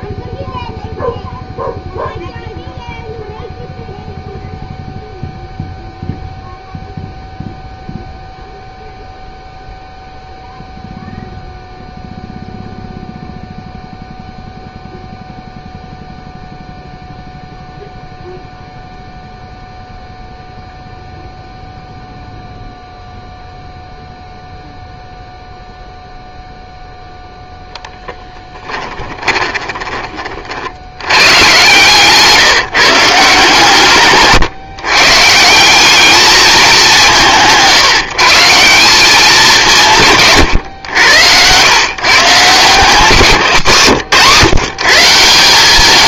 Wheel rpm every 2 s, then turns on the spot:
0, 0, 0, 0, 0, 0, 0, 0, 0, 0, 0, 0, 0, 0, 10, 60, 160, 140, 200, 170, 110, 170, 170.
28-30